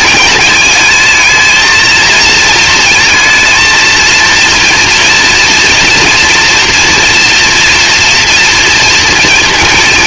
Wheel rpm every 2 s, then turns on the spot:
220, 230, 230, 230, 240.
none